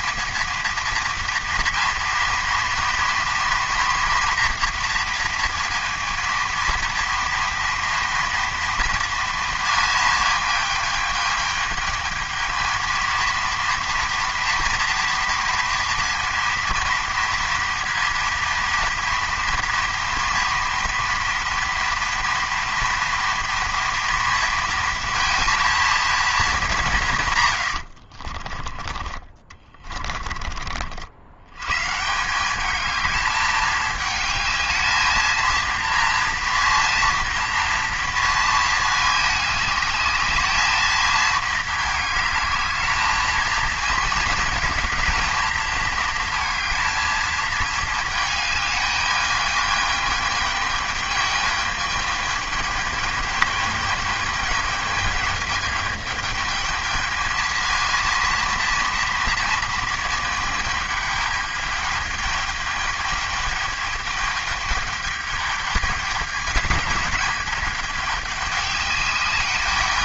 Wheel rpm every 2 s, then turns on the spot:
230, 230, 230, 230, 230, 210, 230, 230, 230, 230, 230, 230, 230, 190, 30, 50, 210, 220, 230, 220, 220, 220, 220, 220, 210, 210, 210, 210, 220, 230, 210, 210, 210, 220, 200.
none